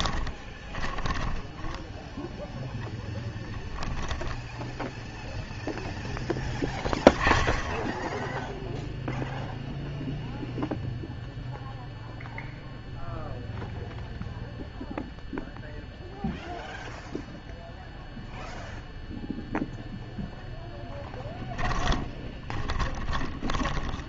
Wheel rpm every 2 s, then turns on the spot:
20, 0, 0, 10, 0, 0, 0, 0, 0, 0, 0, 20.
0-2 22-24